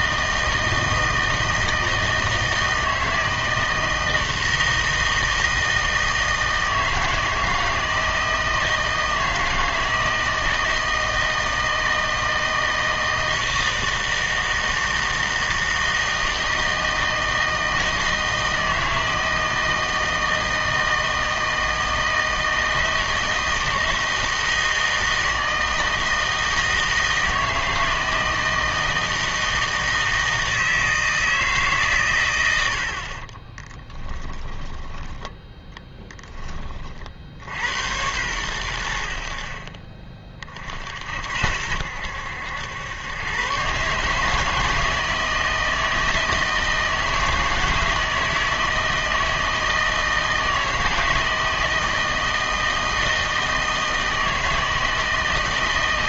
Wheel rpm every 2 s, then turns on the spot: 160, 160, 160, 160, 160, 160, 160, 160, 160, 160, 160, 160, 160, 160, 160, 160, 90, 10, 30, 90, 50, 90, 160, 160, 160, 160, 160, 160.
34-36